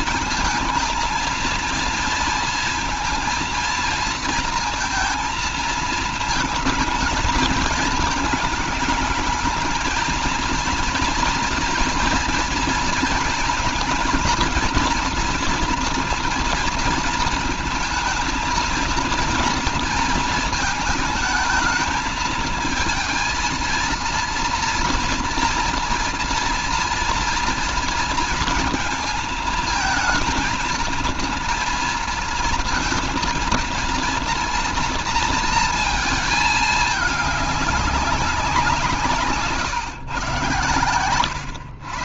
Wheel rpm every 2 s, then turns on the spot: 220, 230, 230, 220, 220, 230, 230, 230, 230, 230, 220, 230, 240, 230, 230, 220, 230, 230, 220, 180, 120.
none